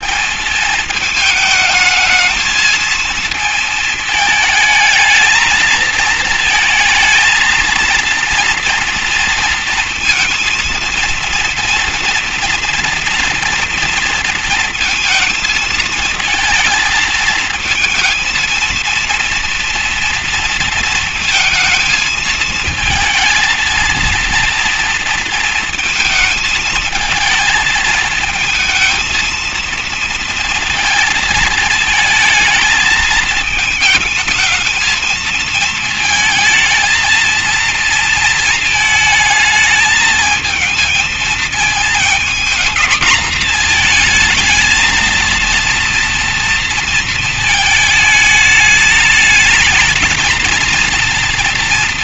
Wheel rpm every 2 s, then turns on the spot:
220, 230, 220, 230, 230, 230, 230, 230, 230, 230, 230, 220, 230, 220, 230, 230, 220, 220, 230, 220, 220, 230, 220, 230, 210, 230.
none